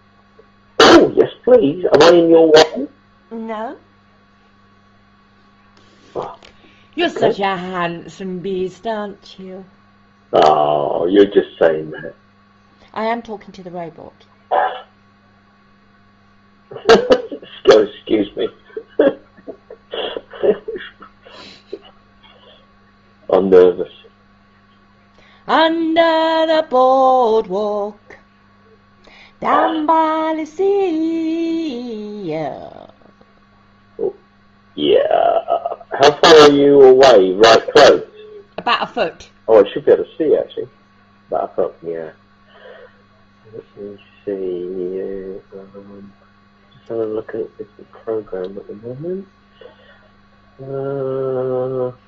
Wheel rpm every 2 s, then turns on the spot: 0, 0, 0, 0, 0, 0, 0, 0, 0, 0, 0, 0, 0, 0, 0, 0, 0, 0, 0, 0, 0, 0, 0, 0, 0, 0.
none